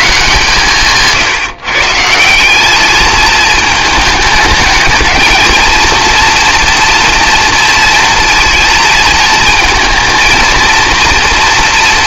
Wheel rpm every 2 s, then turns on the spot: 150, 190, 210, 230, 230, 230.
none